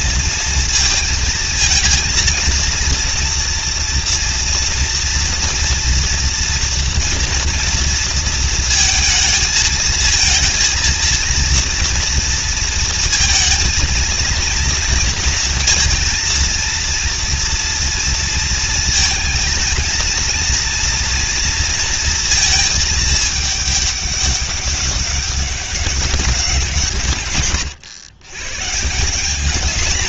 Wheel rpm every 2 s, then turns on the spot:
230, 230, 230, 230, 230, 230, 230, 230, 230, 230, 230, 220, 200, 170, 130.
none